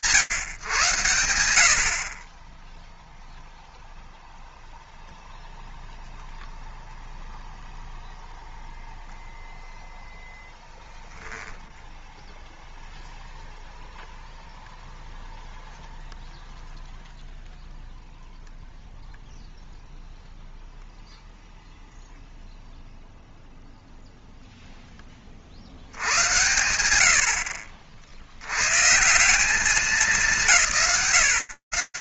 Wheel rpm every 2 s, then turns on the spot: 110, 10, 0, 0, 0, 0, 0, 0, 0, 0, 0, 0, 20, 80, 160, 130.
none